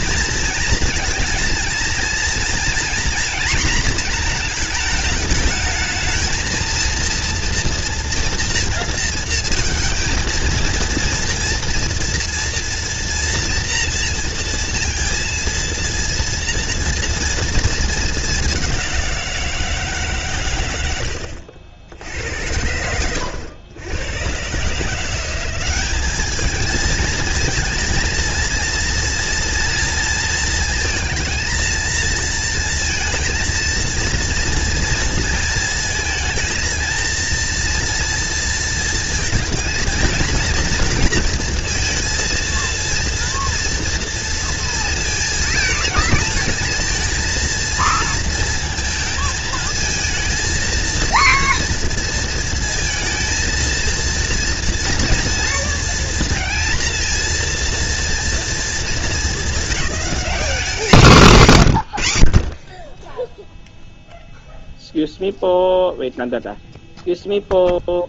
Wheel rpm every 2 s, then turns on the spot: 230, 240, 230, 220, 230, 230, 230, 230, 230, 200, 100, 80, 150, 210, 230, 230, 230, 230, 230, 230, 230, 230, 230, 230, 230, 220, 230, 230, 230, 210, 170, 20, 0, 0.
none